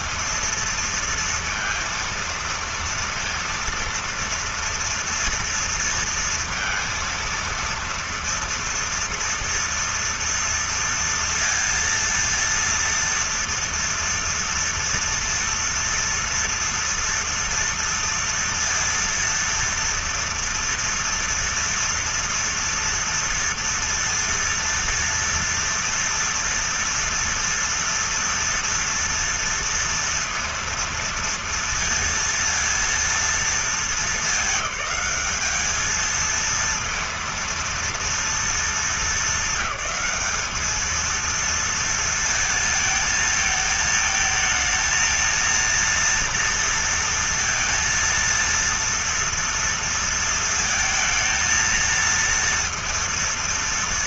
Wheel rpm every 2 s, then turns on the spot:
230, 230, 230, 230, 230, 230, 230, 240, 230, 230, 230, 230, 230, 230, 230, 230, 230, 210, 230, 230, 210, 220, 220, 230, 230, 230, 230.
none